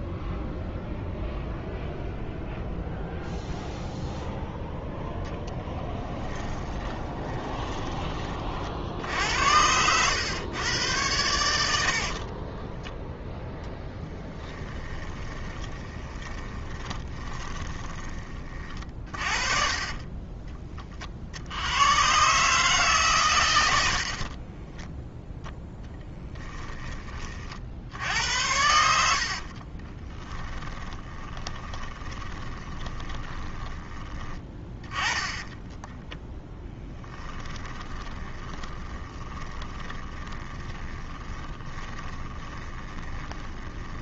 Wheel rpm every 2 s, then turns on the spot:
0, 0, 0, 10, 50, 100, 10, 10, 20, 30, 30, 140, 20, 20, 70, 10, 20, 30, 10, 20, 10, 20.
6-8 12-18 24-26 30-44